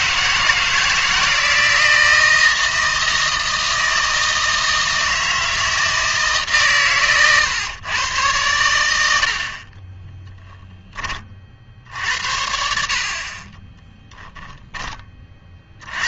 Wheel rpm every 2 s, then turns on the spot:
160, 160, 160, 130, 90, 10, 60, 10.
none